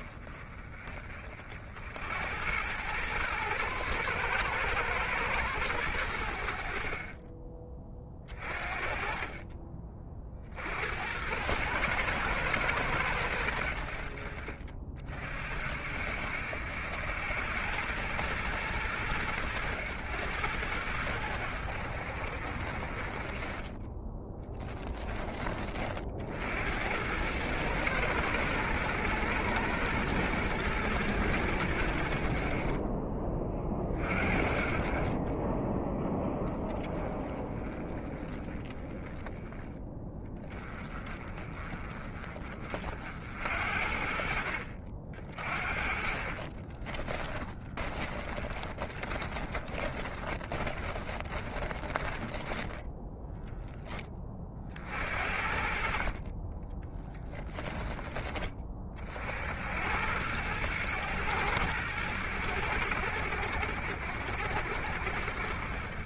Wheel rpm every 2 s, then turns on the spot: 40, 110, 110, 40, 40, 80, 100, 50, 80, 110, 90, 40, 10, 90, 100, 110, 30, 40, 10, 10, 20, 50, 60, 20, 20, 20, 10, 50, 20, 40, 110, 90, 80.
46-54 56-58